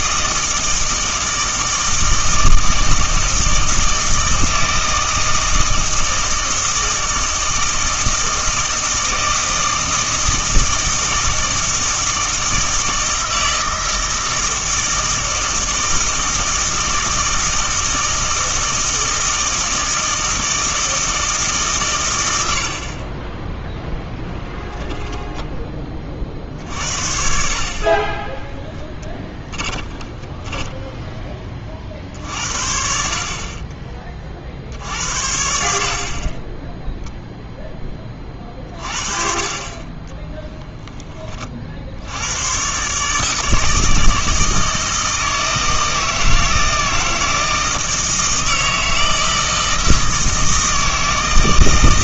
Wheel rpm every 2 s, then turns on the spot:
160, 160, 160, 160, 160, 160, 160, 160, 160, 160, 160, 60, 10, 50, 20, 10, 60, 70, 10, 40, 0, 130, 160, 160, 160, 160.
22-26 28-32